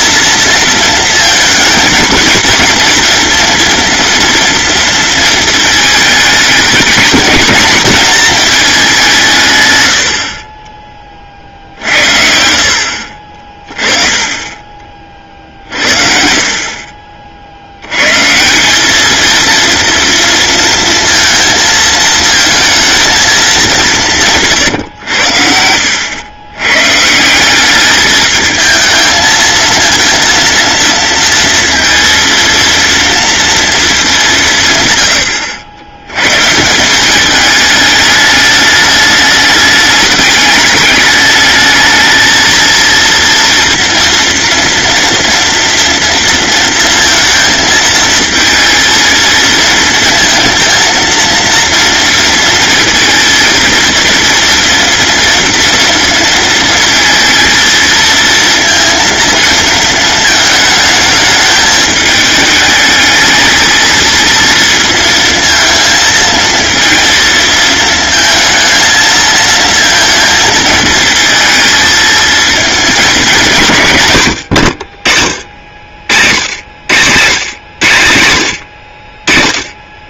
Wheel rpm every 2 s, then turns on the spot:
220, 240, 230, 220, 200, 30, 50, 30, 40, 200, 230, 230, 110, 130, 220, 230, 230, 130, 170, 210, 210, 230, 230, 230, 230, 230, 230, 230, 230, 220, 220, 220, 230, 230, 220, 220, 210, 50, 130, 50.
12-14 16-18